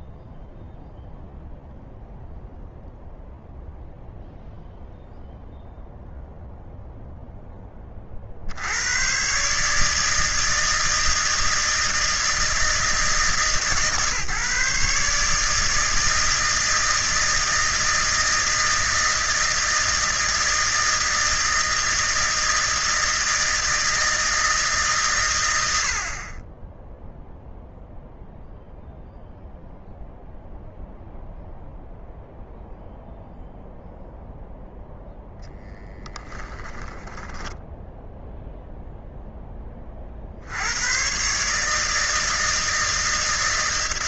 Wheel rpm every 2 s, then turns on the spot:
0, 0, 0, 0, 70, 160, 160, 150, 160, 160, 160, 160, 150, 0, 0, 0, 0, 0, 10, 10, 130, 160.
none